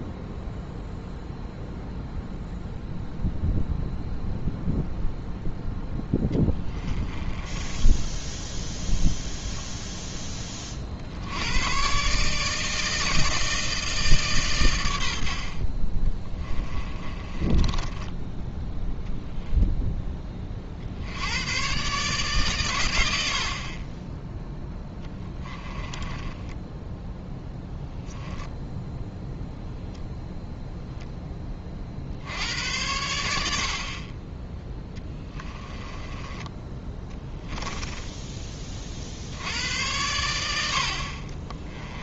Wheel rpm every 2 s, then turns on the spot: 0, 0, 0, 20, 0, 40, 160, 110, 20, 0, 50, 120, 10, 10, 0, 0, 80, 10, 10, 30, 70.
6-8 16-18 24-28